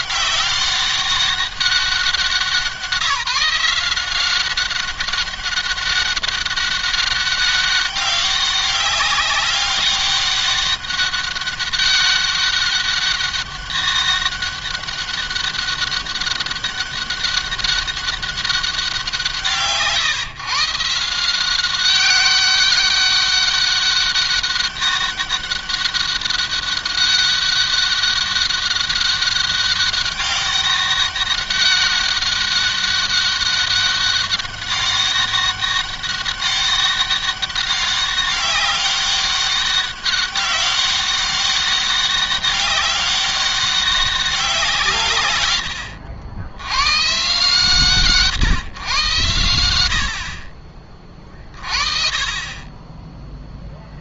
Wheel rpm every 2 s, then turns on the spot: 190, 170, 190, 200, 200, 200, 200, 200, 200, 190, 160, 200, 200, 200, 200, 200, 200, 200, 190, 190, 190, 200, 160, 120, 130, 40, 30.
none